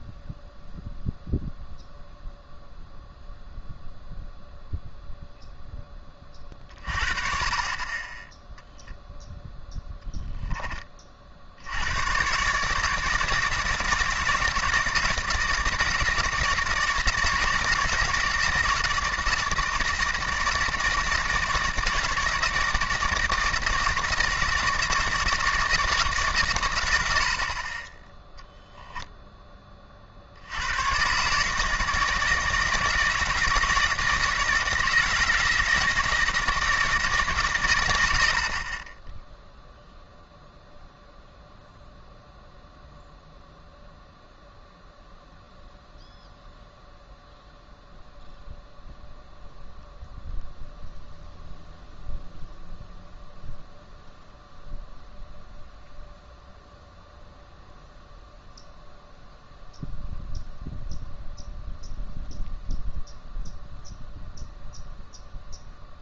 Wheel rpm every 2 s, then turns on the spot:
0, 0, 0, 30, 0, 20, 150, 170, 170, 160, 160, 160, 160, 100, 10, 110, 160, 160, 160, 30, 0, 0, 0, 0, 0, 0, 0, 0, 0, 0, 0, 0, 0.
none